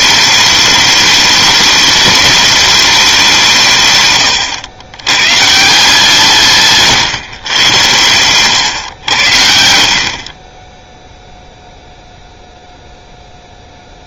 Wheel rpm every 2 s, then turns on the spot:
210, 210, 110, 140, 110, 10, 0.
6-8